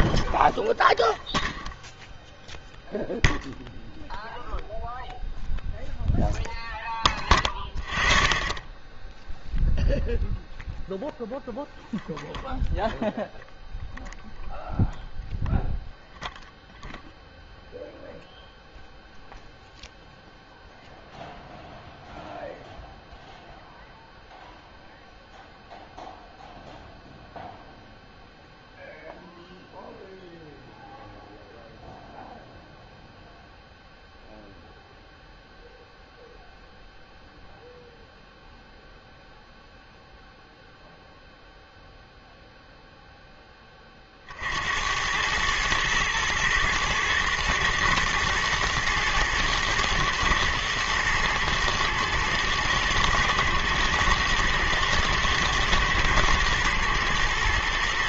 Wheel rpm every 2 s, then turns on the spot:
0, 0, 0, 0, 0, 0, 0, 0, 0, 0, 0, 0, 0, 0, 0, 0, 0, 0, 0, 0, 0, 0, 70, 110, 110, 110, 110, 110, 110.
none